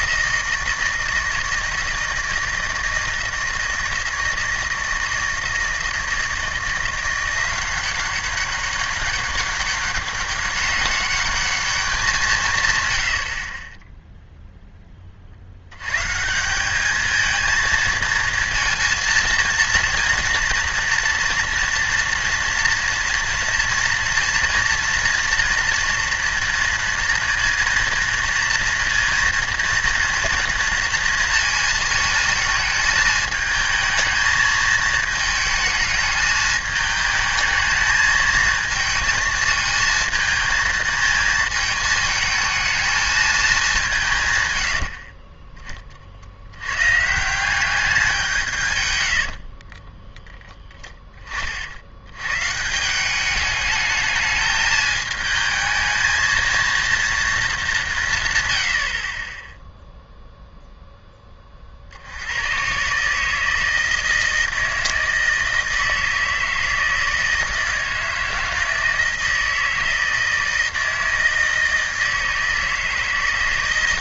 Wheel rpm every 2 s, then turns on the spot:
160, 160, 160, 170, 190, 200, 150, 0, 190, 230, 230, 230, 230, 230, 230, 230, 220, 220, 210, 220, 220, 220, 100, 100, 140, 10, 150, 210, 230, 100, 0, 110, 160, 160, 160, 160, 160.
none